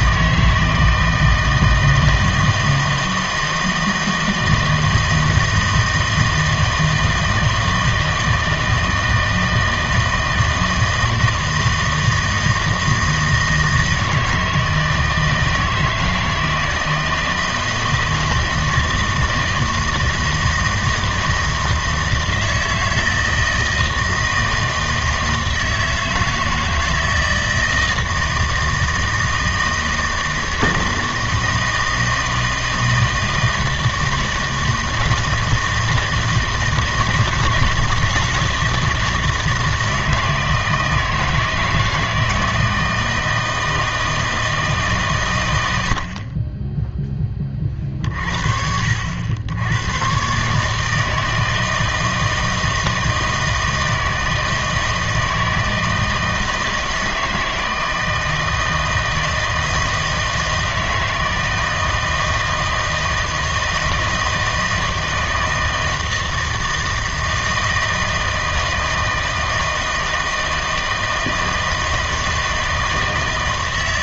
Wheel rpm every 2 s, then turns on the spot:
160, 160, 160, 160, 160, 160, 160, 160, 160, 160, 160, 160, 160, 160, 160, 160, 160, 160, 160, 160, 160, 160, 150, 10, 60, 150, 160, 160, 160, 160, 160, 160, 160, 160, 160, 160, 160.
none